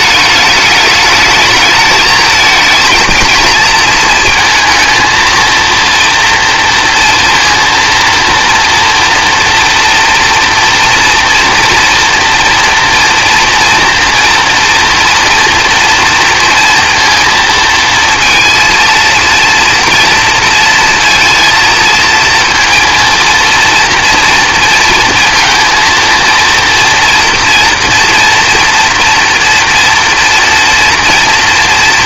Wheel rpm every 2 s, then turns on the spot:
210, 220, 230, 230, 230, 230, 230, 230, 230, 230, 230, 230, 230, 230, 230, 230.
none